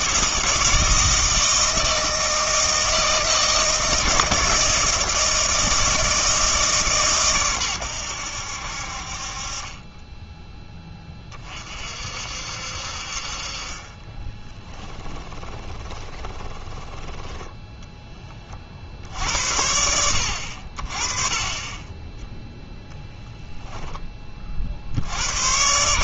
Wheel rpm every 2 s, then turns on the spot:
160, 160, 160, 150, 70, 10, 60, 20, 20, 40, 60, 10, 40.
14-18